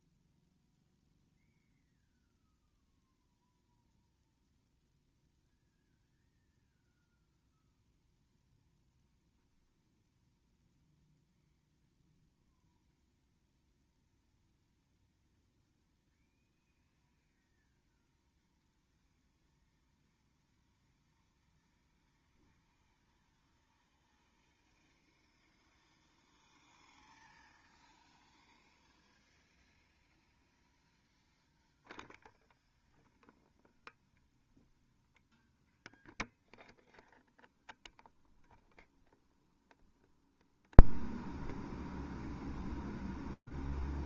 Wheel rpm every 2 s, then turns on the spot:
0, 0, 0, 0, 0, 0, 0, 0, 0, 0, 0, 0, 0, 0, 0, 0, 0, 0, 0, 0, 0, 0.
none